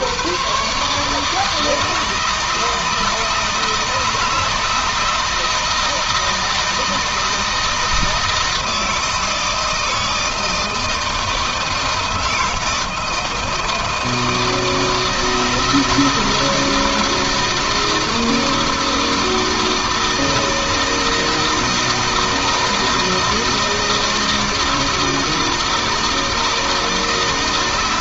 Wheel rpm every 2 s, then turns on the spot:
110, 160, 160, 160, 160, 160, 160, 160, 160, 160, 160, 160, 160, 160.
none